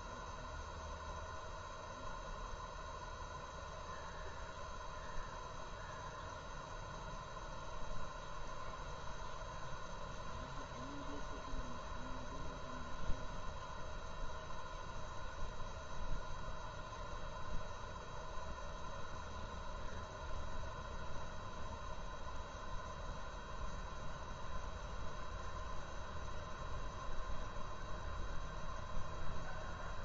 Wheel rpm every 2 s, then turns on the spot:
0, 0, 0, 0, 0, 0, 0, 0, 0, 0, 0, 0, 0, 0, 0.
none